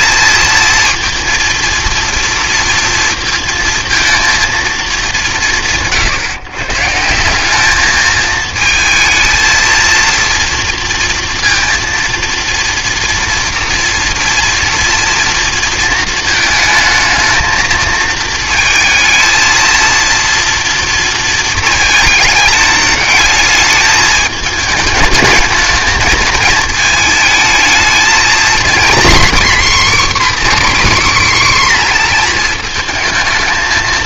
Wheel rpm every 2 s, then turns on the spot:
220, 230, 230, 140, 220, 230, 230, 230, 220, 220, 230, 220, 220, 220, 240, 280, 230.
none